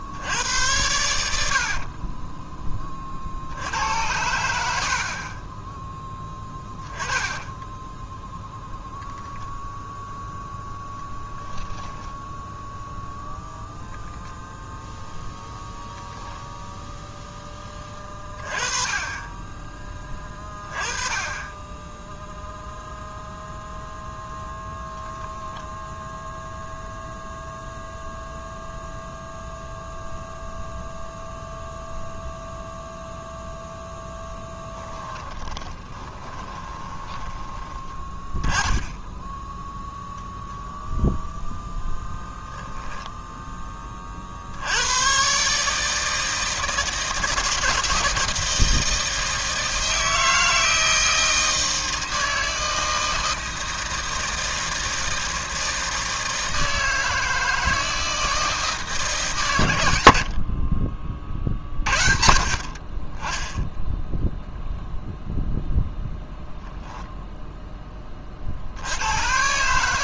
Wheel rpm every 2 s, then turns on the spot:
90, 10, 70, 20, 0, 0, 0, 0, 0, 20, 20, 0, 0, 0, 0, 0, 0, 10, 20, 10, 10, 10, 80, 160, 160, 160, 160, 160, 160, 160, 40, 50, 0, 0, 70.
6-8 34-38 60-62